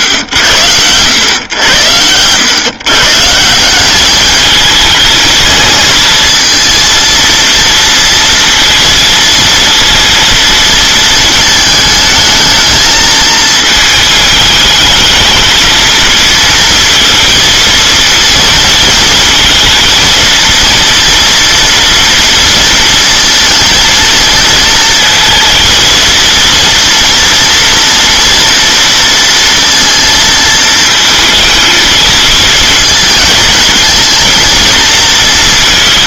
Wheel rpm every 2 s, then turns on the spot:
100, 130, 220, 230, 230, 230, 220, 220, 230, 230, 230, 230, 230, 230, 230, 220, 220, 220.
none